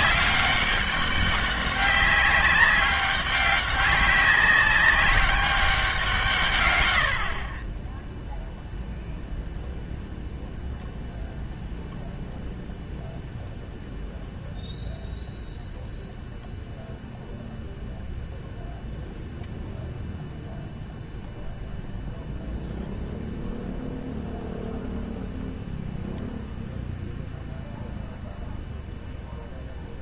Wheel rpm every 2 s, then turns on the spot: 200, 190, 200, 110, 0, 0, 0, 0, 0, 0, 0, 0, 0, 0, 0.
none